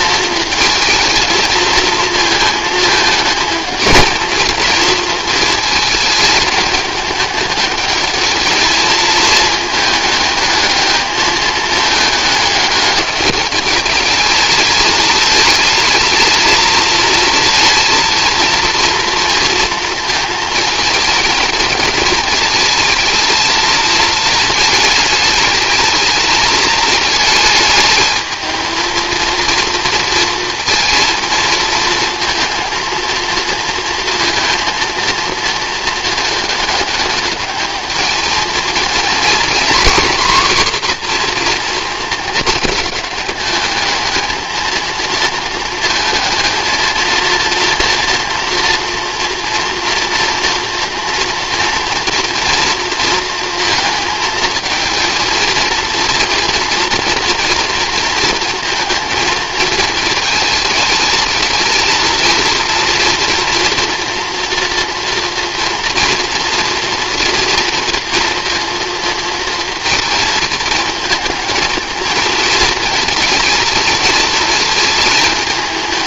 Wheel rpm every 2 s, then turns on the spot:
220, 220, 230, 210, 220, 220, 210, 220, 220, 230, 220, 220, 220, 220, 220, 230, 230, 230, 210, 230, 250, 210, 220, 230, 230, 230, 230, 230, 230, 230, 210, 230, 230, 230, 230, 220, 220, 220.
none